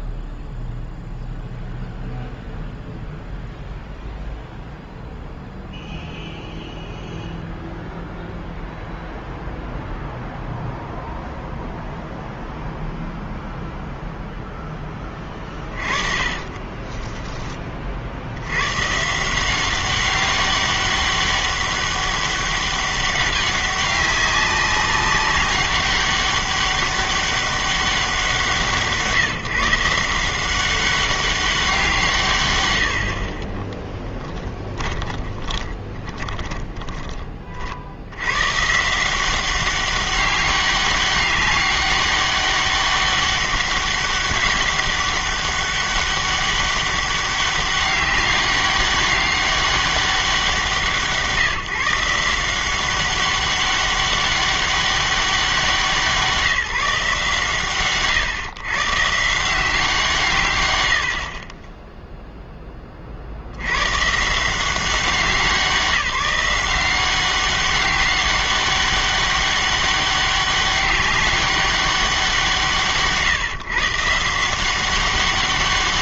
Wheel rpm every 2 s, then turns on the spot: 0, 0, 0, 0, 0, 0, 0, 10, 20, 110, 200, 200, 200, 200, 160, 190, 90, 10, 20, 140, 200, 200, 200, 200, 200, 180, 180, 200, 170, 130, 110, 20, 180, 180, 190, 200, 160, 180.
16-18 34-38